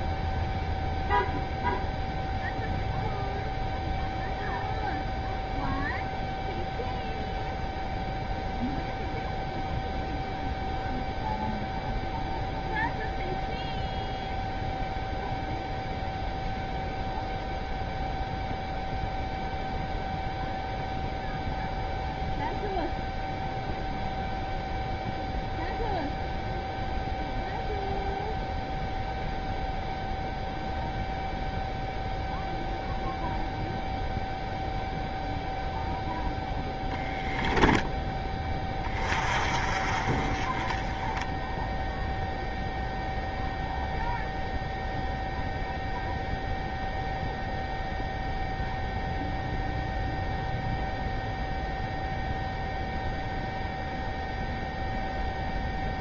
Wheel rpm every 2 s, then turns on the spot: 0, 0, 0, 0, 0, 0, 0, 0, 0, 0, 0, 0, 0, 0, 0, 0, 0, 0, 0, 30, 20, 0, 0, 0, 0, 0, 0, 0.
none